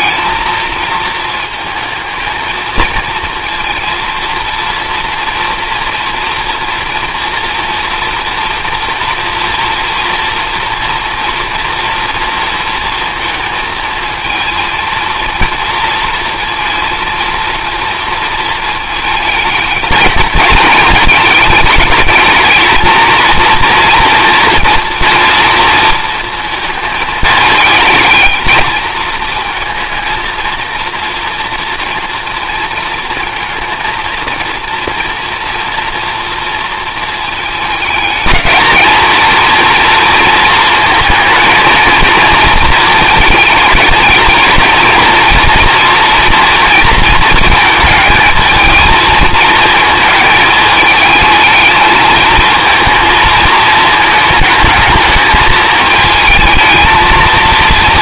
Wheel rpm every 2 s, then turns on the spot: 220, 230, 230, 230, 230, 230, 230, 230, 230, 220, 220, 230, 230, 220, 220, 230, 230, 230, 230, 220, 230, 230, 230, 230, 220, 220, 220, 220, 220.
none